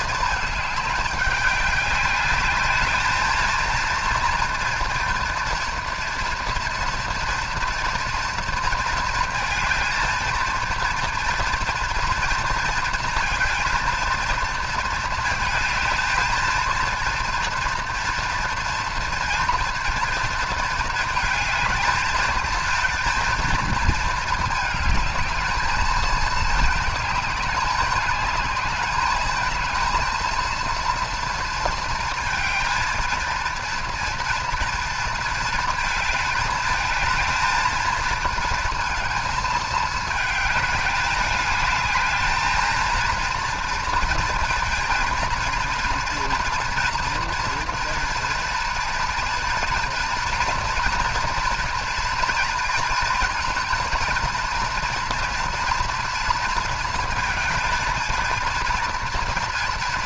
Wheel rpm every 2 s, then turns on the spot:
210, 210, 230, 240, 230, 230, 230, 230, 230, 230, 230, 230, 220, 220, 210, 230, 230, 230, 220, 220, 210, 230, 230, 240, 230, 230, 230, 230, 230, 230.
none